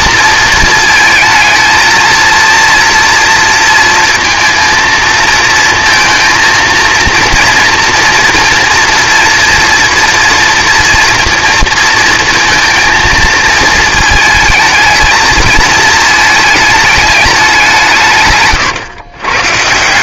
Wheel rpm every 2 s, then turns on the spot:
220, 230, 230, 230, 240, 230, 230, 220, 220, 140.
none